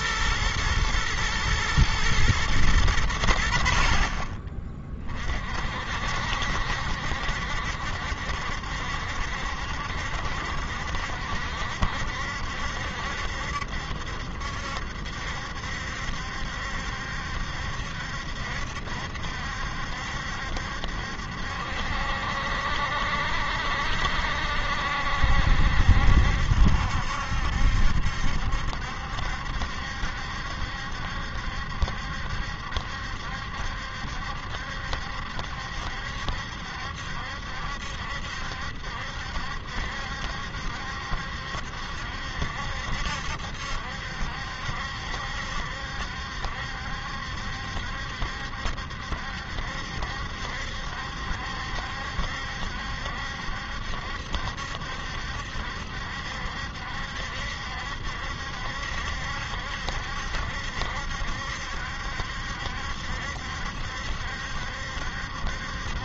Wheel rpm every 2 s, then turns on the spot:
110, 100, 30, 70, 70, 70, 70, 70, 70, 70, 70, 60, 70, 70, 70, 70, 70, 70, 70, 70, 70, 70, 70, 70, 70, 70, 70, 70, 70, 70, 70, 70, 70.
none